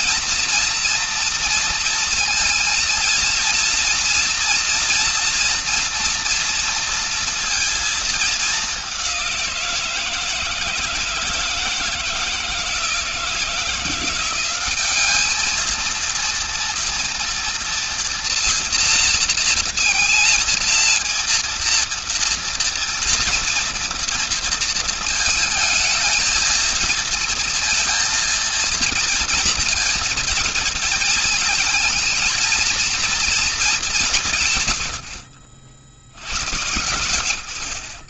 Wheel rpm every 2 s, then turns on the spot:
230, 230, 230, 230, 200, 160, 170, 200, 230, 230, 230, 230, 220, 230, 230, 230, 230, 130, 80.
none